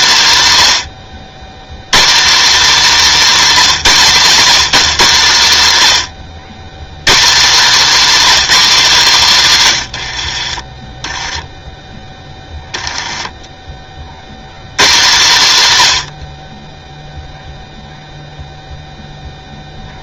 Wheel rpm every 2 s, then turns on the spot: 140, 240, 150, 150, 220, 20, 20, 150, 0, 0.
12-14